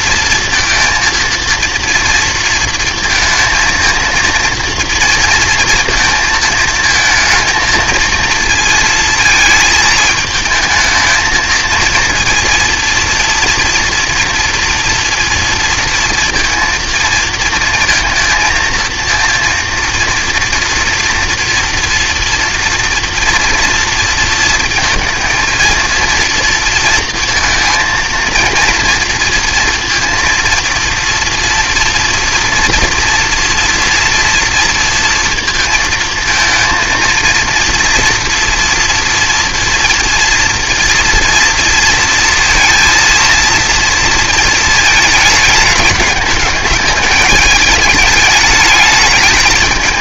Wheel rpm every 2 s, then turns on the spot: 230, 230, 230, 220, 230, 220, 230, 230, 230, 230, 230, 230, 230, 230, 230, 230, 230, 230, 230, 230, 230, 230, 220, 210, 210.
none